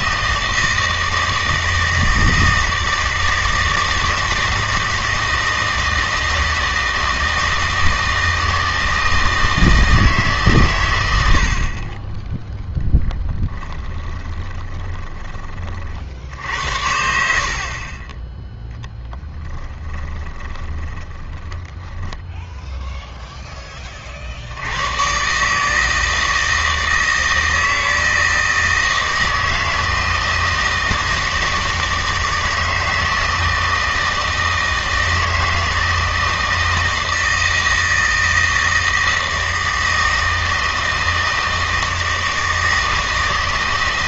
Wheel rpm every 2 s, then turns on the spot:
160, 160, 160, 160, 160, 120, 0, 20, 70, 0, 20, 0, 100, 160, 160, 160, 160, 160, 160, 160, 160, 160.
14-16 20-22